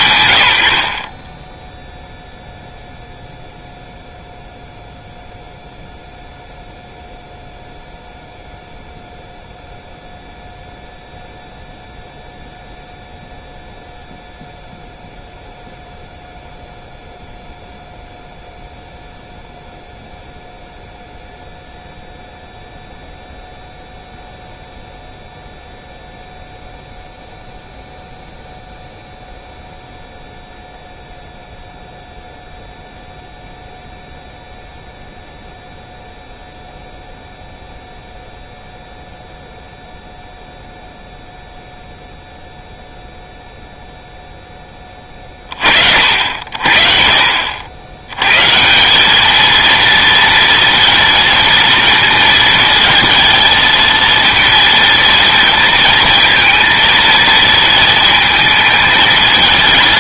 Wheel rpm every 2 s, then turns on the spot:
80, 0, 0, 0, 0, 0, 0, 0, 0, 0, 0, 0, 0, 0, 0, 0, 0, 0, 0, 0, 0, 0, 10, 50, 160, 230, 220, 230, 230, 220.
none